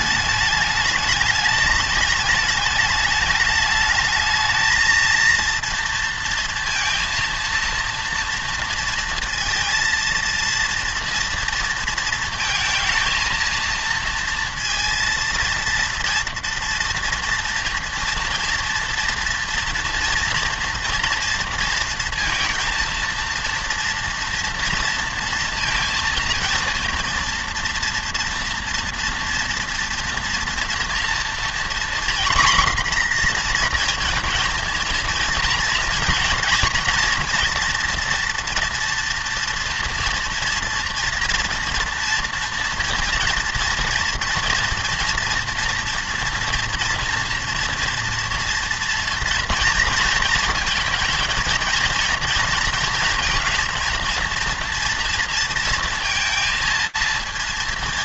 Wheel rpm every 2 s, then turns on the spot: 210, 220, 220, 230, 230, 230, 220, 230, 230, 230, 230, 230, 230, 230, 230, 230, 250, 230, 230, 230, 230, 230, 230, 230, 230, 220, 230, 230, 230.
none